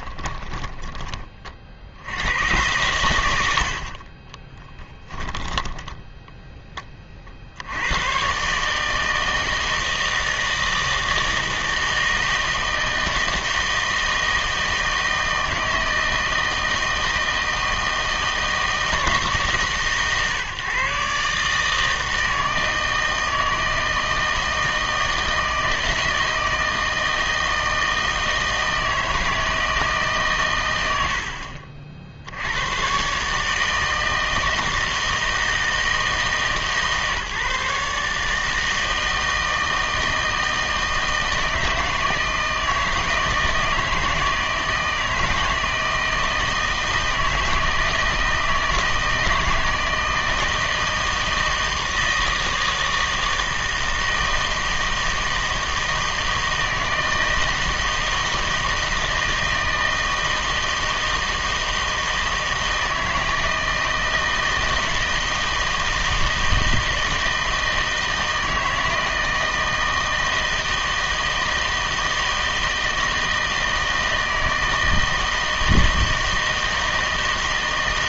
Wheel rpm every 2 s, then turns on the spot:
10, 100, 10, 10, 150, 160, 160, 160, 160, 160, 140, 160, 160, 160, 160, 100, 110, 160, 140, 160, 160, 160, 160, 160, 160, 160, 160, 160, 160, 160, 160, 160, 160, 160, 160, 160, 160, 160, 160.
0-2 4-6